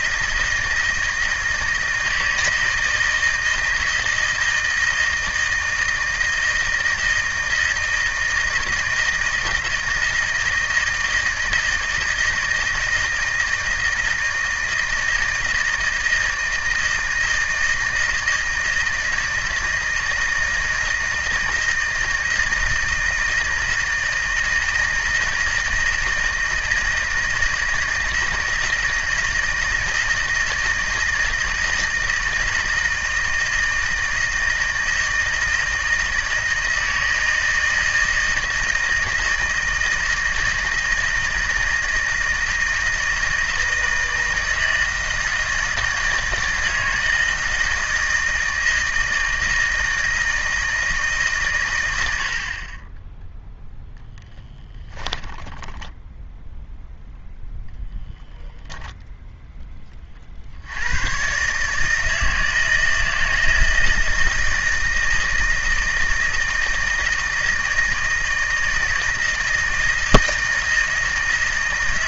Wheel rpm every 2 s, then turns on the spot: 160, 160, 160, 160, 160, 160, 160, 160, 160, 160, 160, 160, 160, 160, 160, 160, 160, 160, 160, 160, 160, 160, 160, 160, 160, 160, 30, 10, 0, 10, 70, 160, 160, 160, 160, 160.
54-56